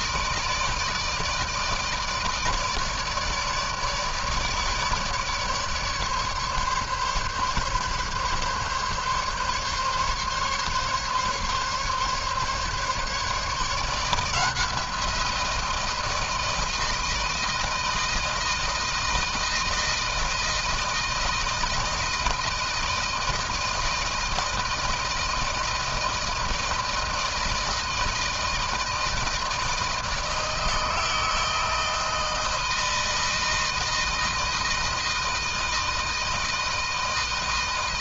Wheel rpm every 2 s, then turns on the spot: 160, 160, 150, 140, 140, 140, 140, 170, 160, 160, 160, 160, 160, 160, 160, 160, 160, 160, 160.
none